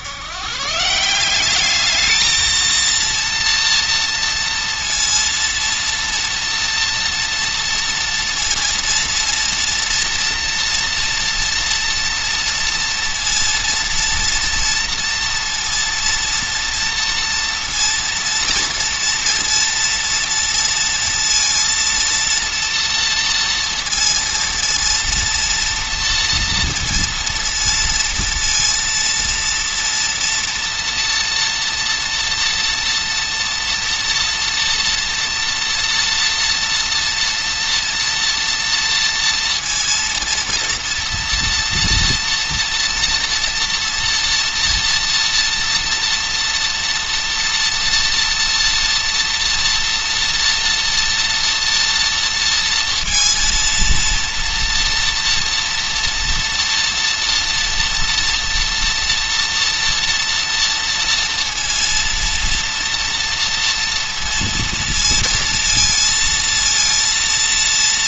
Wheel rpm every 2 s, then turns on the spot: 170, 230, 230, 230, 230, 230, 230, 230, 230, 230, 230, 230, 230, 230, 230, 230, 240, 240, 230, 230, 230, 240, 230, 240, 230, 230, 230, 230, 230, 230, 230, 230, 230, 230.
none